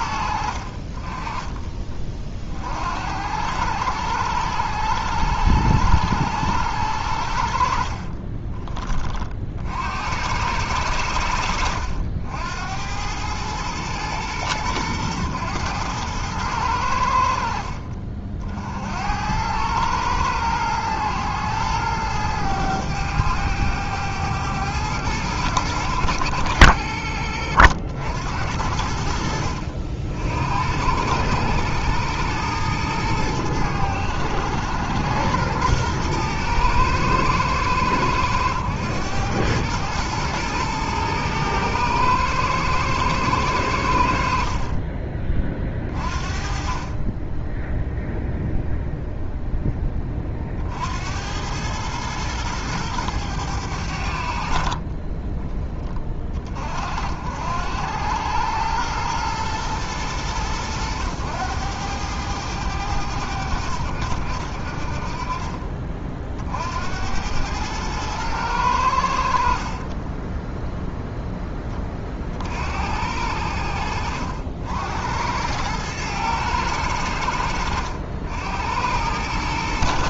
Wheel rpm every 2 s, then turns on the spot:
40, 60, 90, 90, 30, 100, 90, 110, 100, 60, 110, 100, 110, 60, 70, 90, 110, 90, 110, 100, 120, 120, 40, 40, 0, 60, 110, 40, 50, 110, 100, 100, 60, 70, 100, 0, 60, 70, 100, 90.
54-56